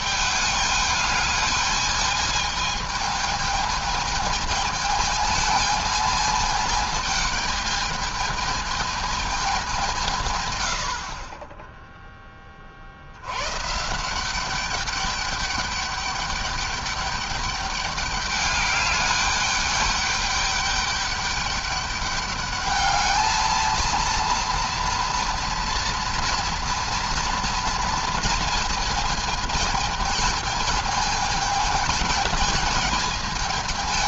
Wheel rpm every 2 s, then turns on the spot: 210, 220, 220, 220, 220, 100, 40, 200, 200, 200, 200, 210, 230, 230, 220, 220, 220.
none